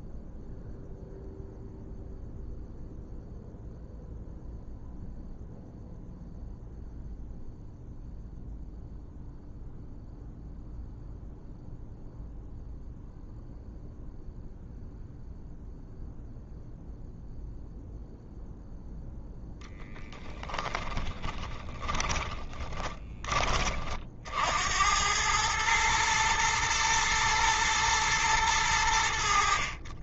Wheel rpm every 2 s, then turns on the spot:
0, 0, 0, 0, 0, 0, 0, 0, 0, 0, 10, 20, 80, 110, 100.
20-24